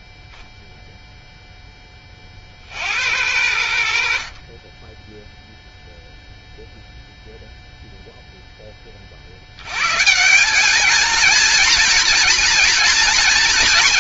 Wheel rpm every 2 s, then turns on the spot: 0, 50, 40, 0, 10, 200, 230.
none